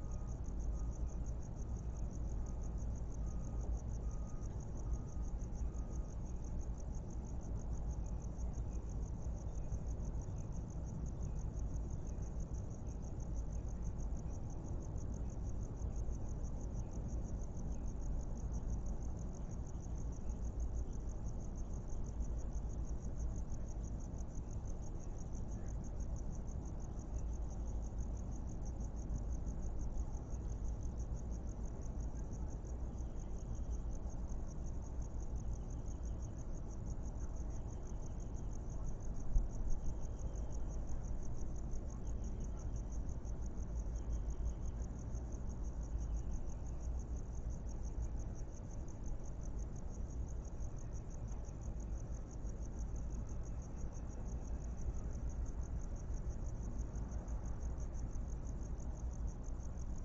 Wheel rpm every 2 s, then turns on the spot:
0, 0, 0, 0, 0, 0, 0, 0, 0, 0, 0, 0, 0, 0, 0, 0, 0, 0, 0, 0, 0, 0, 0, 0, 0, 0, 0, 0, 0, 0.
none